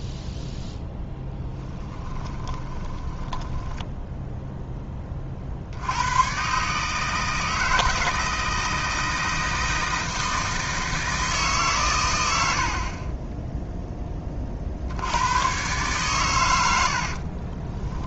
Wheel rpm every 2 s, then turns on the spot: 10, 20, 10, 140, 160, 160, 50, 50, 90.
2-4